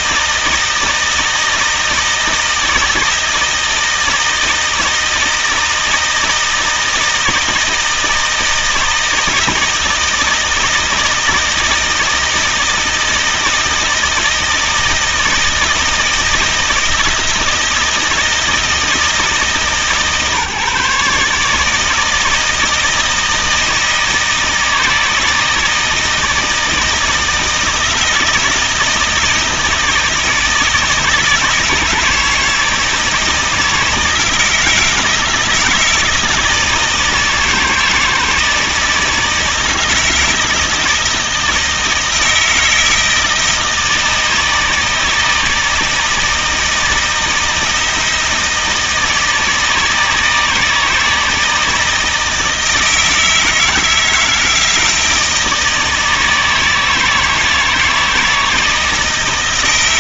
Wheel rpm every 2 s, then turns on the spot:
160, 160, 160, 160, 160, 160, 160, 160, 160, 160, 150, 160, 160, 160, 160, 160, 170, 160, 160, 160, 160, 160, 160, 170, 160, 160, 160, 160, 160, 160.
none